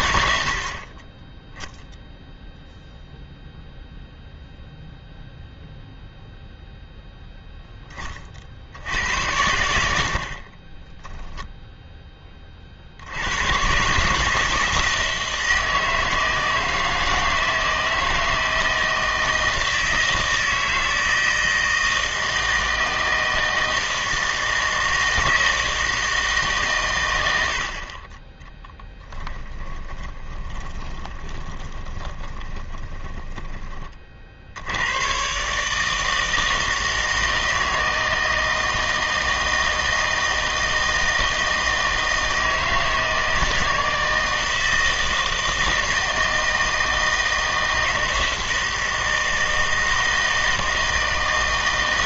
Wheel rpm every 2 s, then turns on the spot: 70, 0, 0, 0, 60, 20, 40, 160, 160, 160, 160, 160, 160, 140, 10, 20, 20, 70, 160, 160, 160, 160, 160, 160, 160, 160.
10-12 28-34